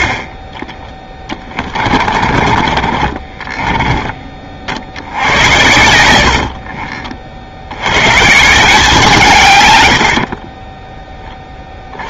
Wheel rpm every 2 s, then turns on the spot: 20, 30, 70, 50, 160, 50.
2-4 6-8 10-12